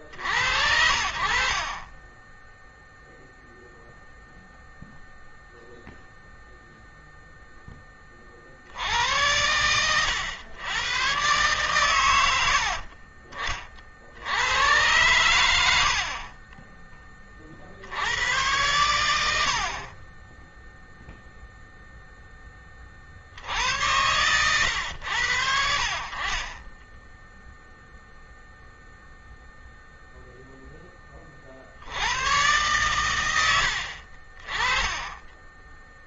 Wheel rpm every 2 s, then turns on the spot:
50, 20, 0, 0, 40, 100, 90, 90, 30, 100, 20, 20, 110, 40, 0, 0, 100, 40.
16-18 26-28